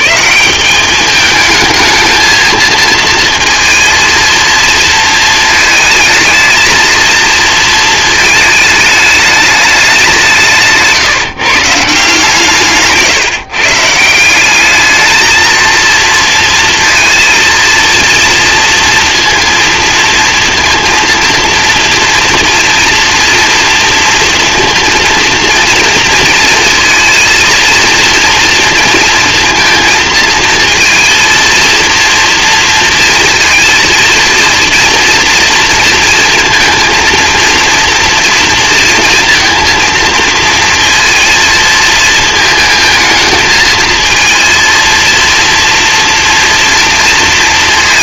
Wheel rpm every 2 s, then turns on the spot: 190, 220, 230, 230, 220, 160, 150, 190, 230, 230, 230, 230, 230, 230, 230, 230, 230, 230, 230, 240, 230, 230, 230, 240.
none